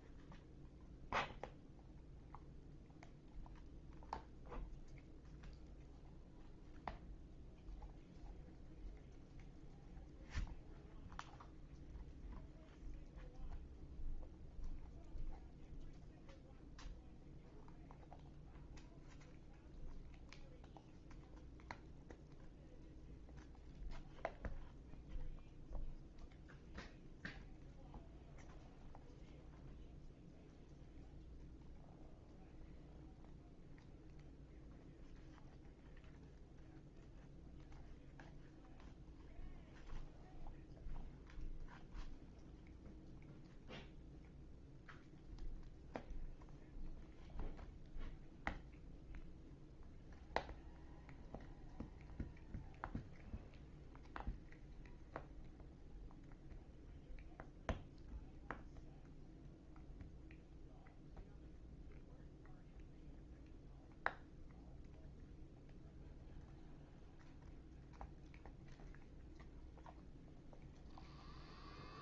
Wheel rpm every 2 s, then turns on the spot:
0, 0, 0, 0, 0, 0, 0, 0, 0, 0, 0, 0, 0, 0, 0, 0, 0, 0, 0, 0, 0, 0, 0, 0, 0, 0, 0, 0, 0, 0, 0, 0, 0, 0, 0, 0.
none